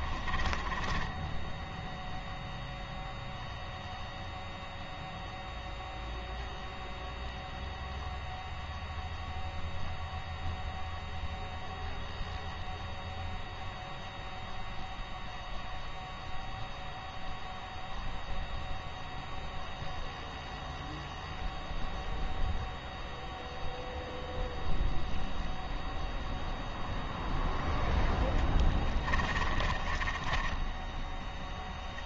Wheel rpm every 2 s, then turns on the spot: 20, 0, 0, 0, 0, 0, 0, 0, 0, 0, 0, 0, 0, 0, 10, 10.
0-2 28-30